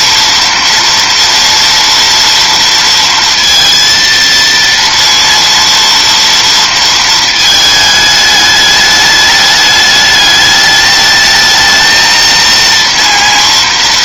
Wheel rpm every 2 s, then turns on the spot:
230, 230, 230, 230, 210, 210, 230.
none